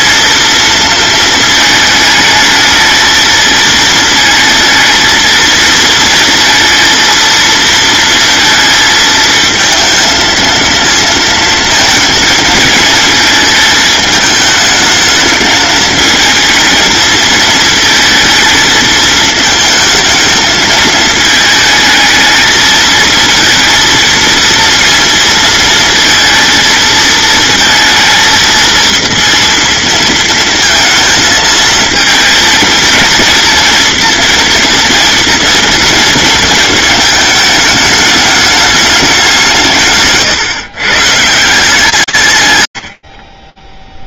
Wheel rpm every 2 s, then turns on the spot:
220, 220, 230, 230, 220, 230, 220, 220, 230, 220, 220, 230, 230, 220, 230, 220, 230, 230, 220, 180, 160, 30.
none